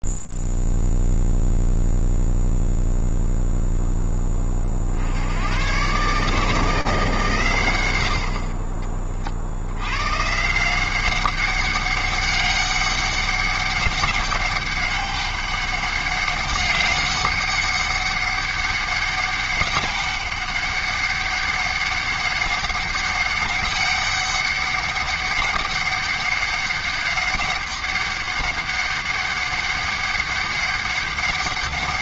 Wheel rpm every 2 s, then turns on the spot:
0, 0, 0, 130, 100, 100, 200, 200, 200, 200, 200, 200, 200, 200, 200, 200.
none